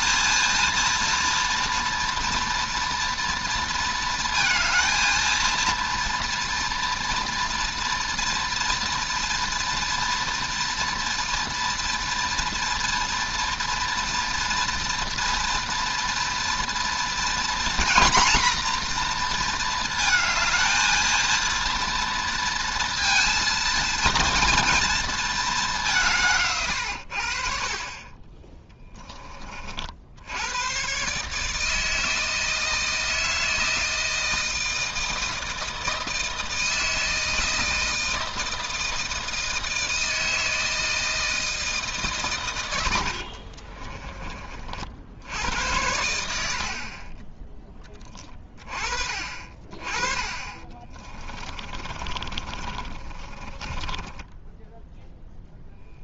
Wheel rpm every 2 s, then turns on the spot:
230, 240, 230, 230, 230, 230, 230, 230, 240, 240, 230, 230, 220, 80, 20, 140, 160, 160, 160, 160, 160, 80, 70, 20, 30, 20, 30, 10.
42-44 50-54